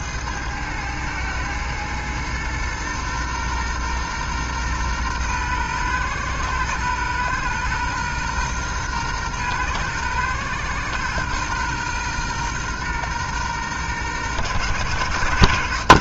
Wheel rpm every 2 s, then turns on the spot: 110, 120, 120, 120, 120, 120, 120, 120.
none